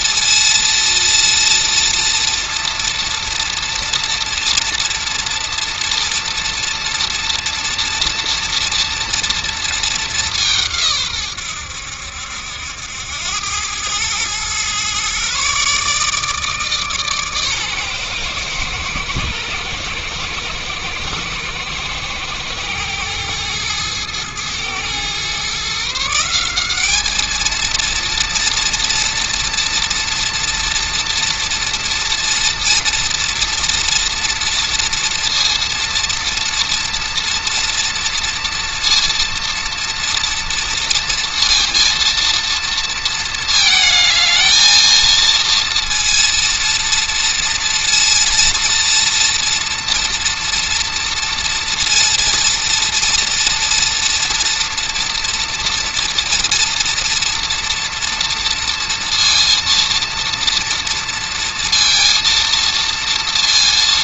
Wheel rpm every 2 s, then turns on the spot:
230, 230, 230, 230, 240, 140, 80, 120, 150, 110, 110, 110, 120, 210, 240, 230, 230, 230, 230, 230, 230, 230, 230, 230, 230, 230, 230, 240, 240, 230, 230, 230.
none